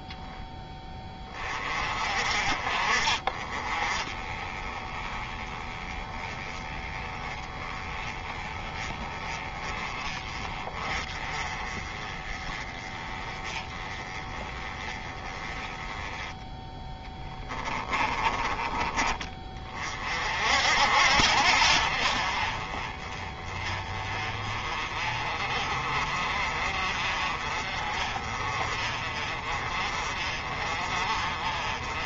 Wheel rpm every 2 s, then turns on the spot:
20, 30, 20, 20, 20, 30, 20, 20, 10, 20, 60, 30, 30, 40, 40, 40.
16-18